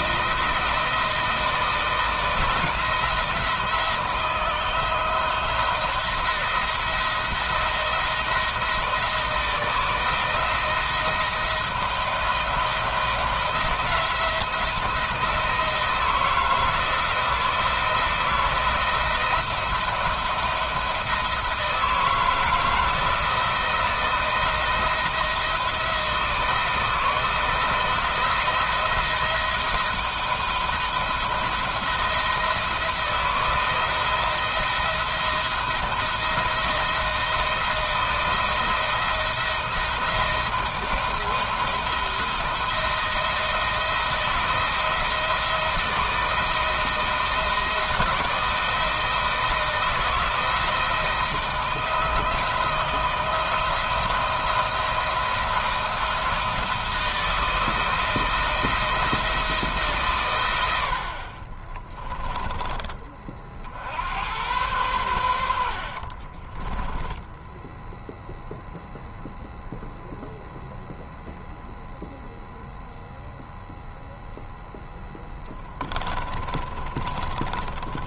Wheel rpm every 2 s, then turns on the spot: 170, 160, 160, 170, 160, 160, 160, 170, 160, 160, 170, 160, 170, 160, 170, 170, 160, 170, 170, 170, 170, 170, 170, 160, 160, 170, 170, 160, 160, 170, 80, 20, 100, 20, 0, 0, 0, 0, 20.
66-68 76-78